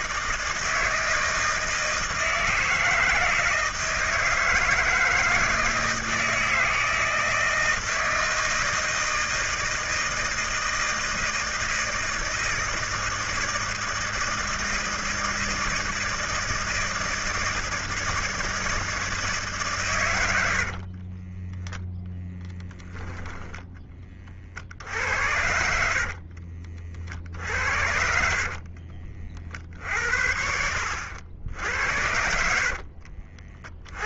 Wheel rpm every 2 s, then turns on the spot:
160, 160, 160, 160, 160, 160, 160, 160, 160, 160, 50, 10, 60, 50, 40, 80, 50.
20-22 26-30 32-34